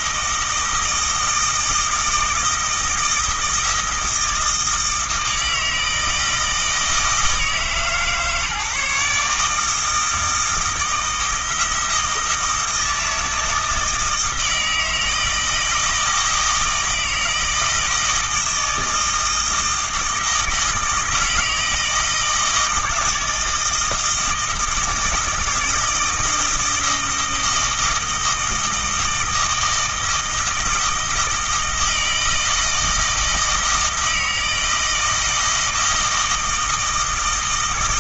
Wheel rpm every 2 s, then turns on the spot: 160, 160, 160, 160, 150, 160, 160, 160, 160, 160, 160, 160, 160, 160, 160, 160, 160, 160, 160.
none